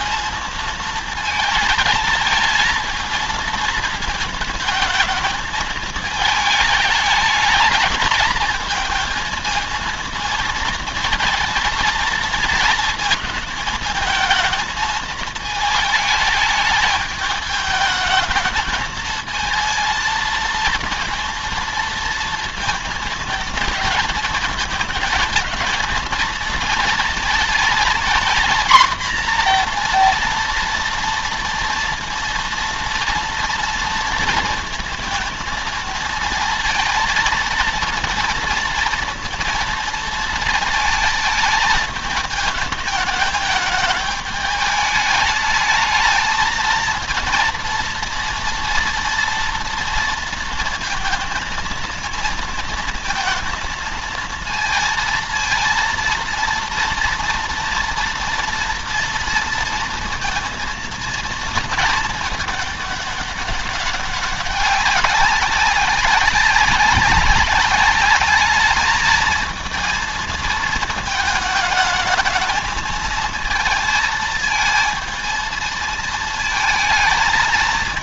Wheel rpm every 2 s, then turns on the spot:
220, 220, 220, 220, 220, 230, 220, 220, 210, 220, 230, 230, 220, 230, 240, 230, 230, 220, 220, 230, 220, 220, 210, 230, 230, 230, 220, 230, 230, 230, 230, 210, 190, 190, 220, 220, 220, 220, 220.
none